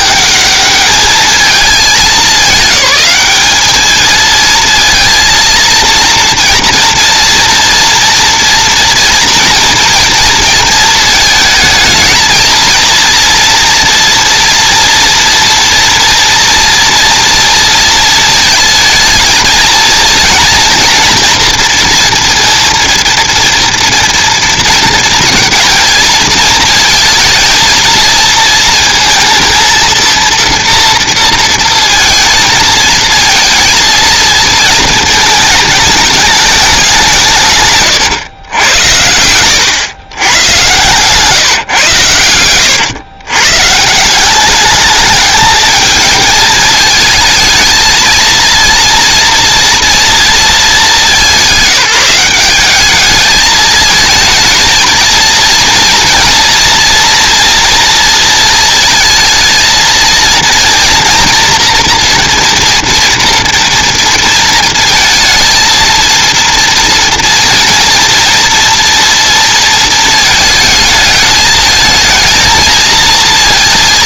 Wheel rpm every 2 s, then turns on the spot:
210, 210, 220, 230, 230, 230, 220, 230, 230, 230, 240, 230, 230, 230, 230, 230, 230, 230, 200, 100, 120, 110, 200, 220, 230, 210, 200, 230, 230, 230, 230, 240, 230, 230, 230, 220, 230.
none